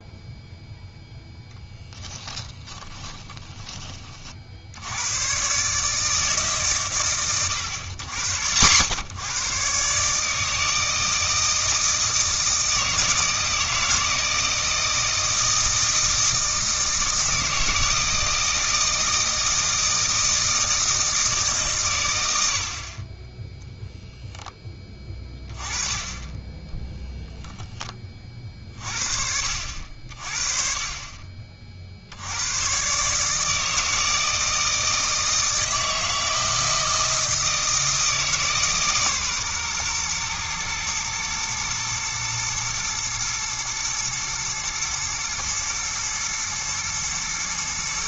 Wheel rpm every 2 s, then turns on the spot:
0, 20, 80, 140, 90, 160, 160, 160, 160, 160, 160, 50, 10, 10, 40, 30, 130, 160, 160, 140, 120, 120, 110, 110.
2-4